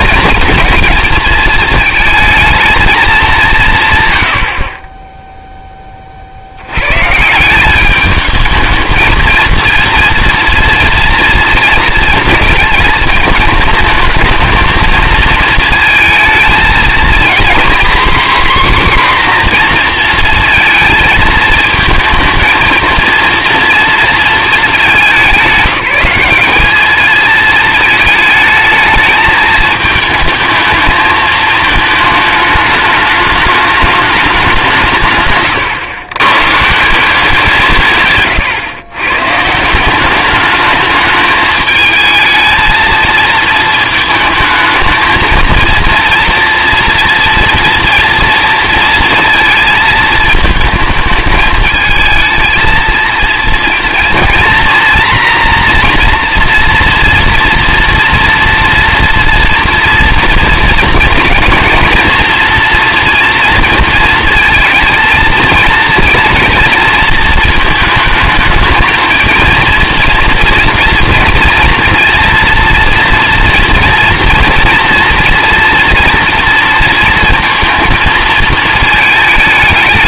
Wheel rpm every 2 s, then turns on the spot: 220, 220, 40, 80, 220, 230, 220, 220, 230, 260, 230, 230, 210, 210, 220, 220, 210, 180, 140, 120, 210, 220, 220, 230, 230, 220, 220, 230, 240, 240, 230, 230, 230, 230, 220, 230, 230, 230, 230, 220.
none